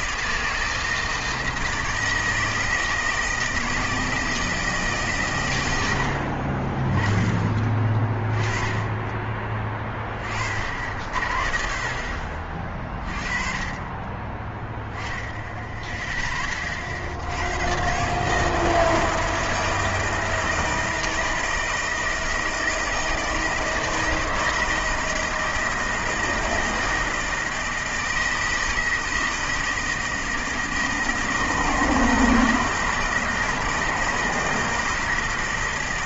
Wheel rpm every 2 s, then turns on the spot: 160, 160, 160, 40, 20, 60, 40, 10, 30, 160, 160, 160, 160, 160, 160, 160, 160, 160.
none